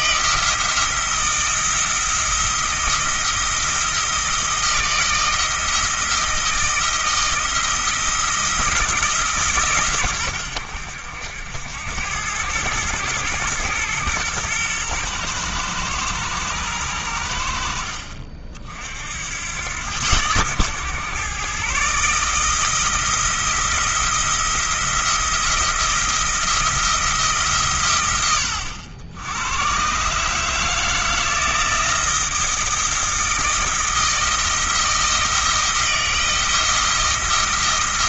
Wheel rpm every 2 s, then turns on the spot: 170, 160, 160, 160, 160, 80, 110, 110, 100, 60, 120, 160, 170, 170, 90, 160, 170, 160, 160.
none